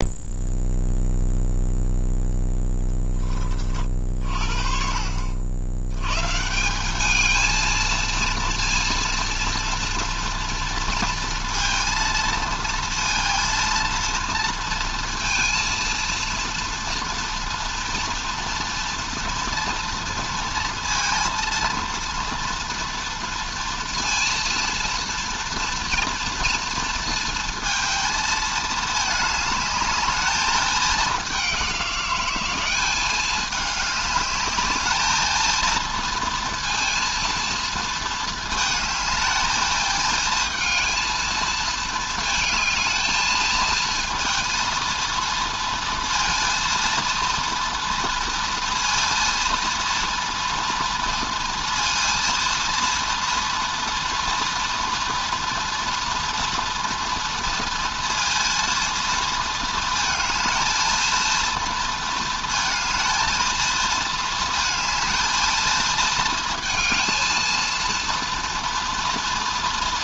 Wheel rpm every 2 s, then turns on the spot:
0, 0, 50, 170, 230, 230, 230, 230, 230, 230, 240, 240, 230, 240, 220, 210, 190, 210, 230, 220, 230, 220, 230, 230, 230, 230, 230, 230, 230, 230, 220, 230, 220, 220, 240.
none